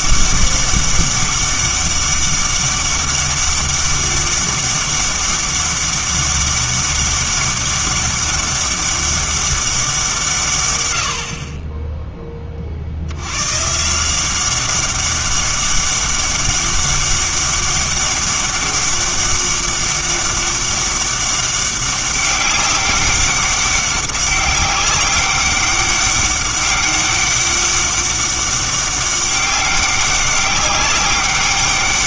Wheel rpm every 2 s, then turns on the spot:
200, 200, 200, 200, 200, 110, 50, 190, 200, 200, 200, 200, 200, 200, 200, 200.
none